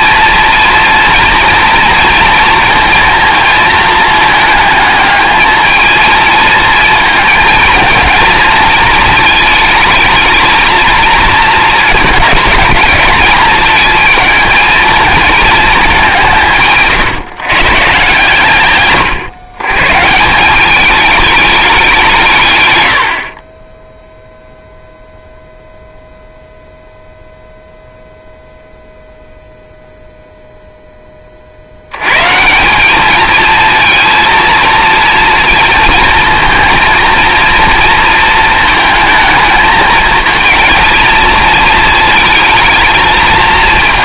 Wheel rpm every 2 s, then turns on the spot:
230, 230, 220, 230, 220, 220, 220, 220, 140, 120, 200, 100, 0, 0, 0, 0, 170, 230, 230, 220, 230, 230.
18-20